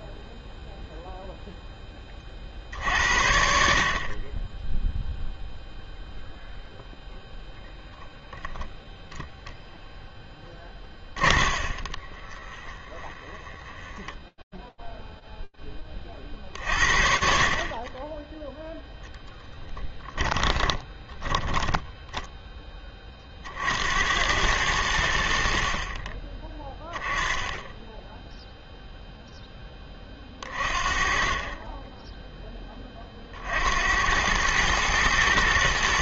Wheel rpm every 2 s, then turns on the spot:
0, 40, 40, 0, 0, 20, 20, 0, 50, 0, 10, 40, 70, 10, 10, 20, 70, 120.
10-14 20-22